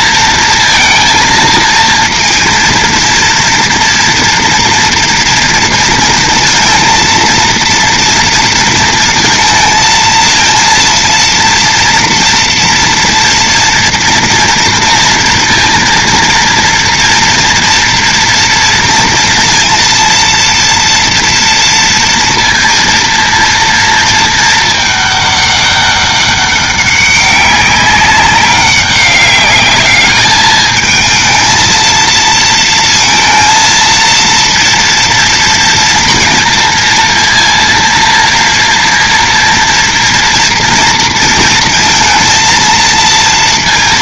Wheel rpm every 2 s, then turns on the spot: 230, 230, 230, 230, 230, 230, 240, 230, 230, 230, 230, 230, 220, 200, 200, 210, 230, 230, 230, 240, 230, 230.
none